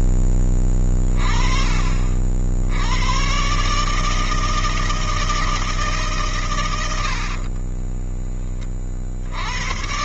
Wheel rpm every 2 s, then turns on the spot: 30, 90, 160, 100, 30.
none